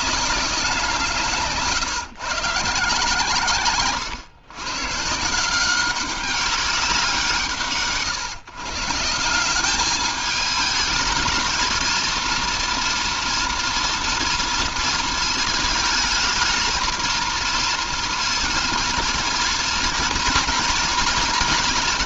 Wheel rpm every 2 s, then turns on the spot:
170, 140, 150, 180, 170, 220, 230, 230, 230, 230, 230.
none